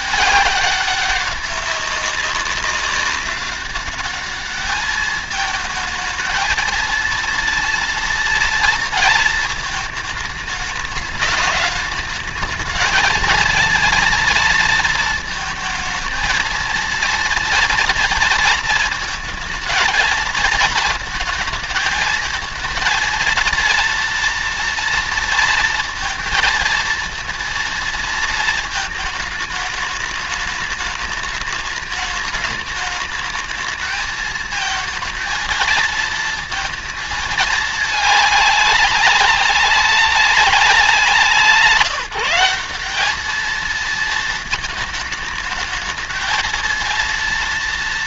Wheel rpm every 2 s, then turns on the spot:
200, 190, 210, 220, 230, 210, 220, 230, 230, 230, 230, 220, 230, 230, 220, 210, 210, 220, 230, 200, 190, 190, 220, 220.
none